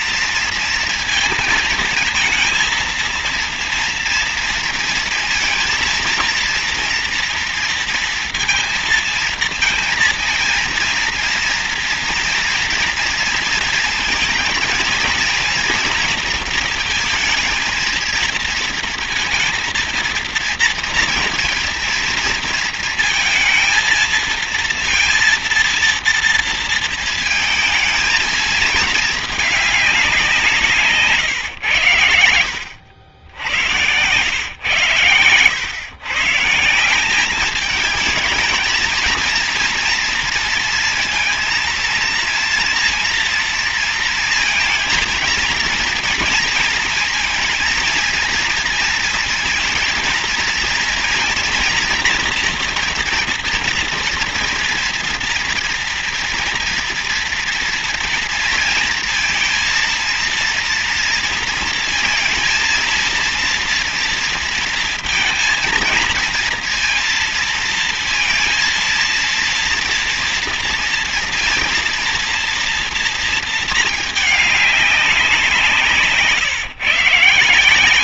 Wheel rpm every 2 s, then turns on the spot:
230, 230, 230, 230, 230, 230, 230, 230, 230, 230, 230, 230, 230, 230, 220, 170, 80, 120, 160, 230, 230, 230, 230, 220, 230, 230, 240, 230, 230, 230, 230, 230, 230, 230, 230, 230, 230, 210, 160.
none